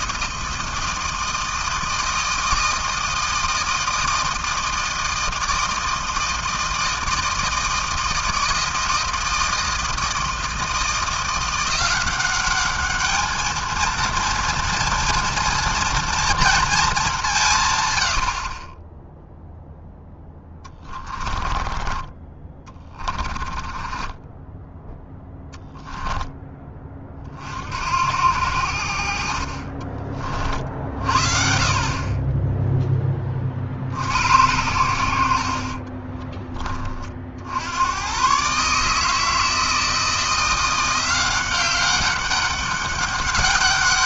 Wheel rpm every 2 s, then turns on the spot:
160, 160, 160, 160, 160, 160, 200, 230, 230, 50, 10, 20, 10, 20, 80, 40, 10, 90, 20, 130, 170, 200.
20-26